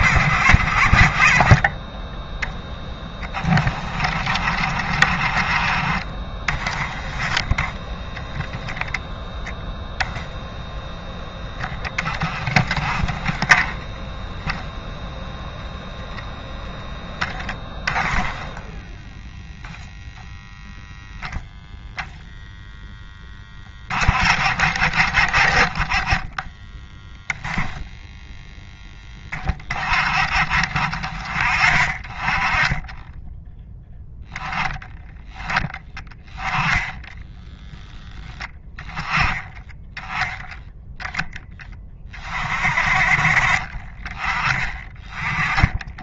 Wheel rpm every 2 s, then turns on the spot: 50, 10, 20, 20, 0, 0, 20, 0, 0, 0, 0, 0, 30, 10, 10, 30, 10, 20, 10, 20, 0, 30, 20.
none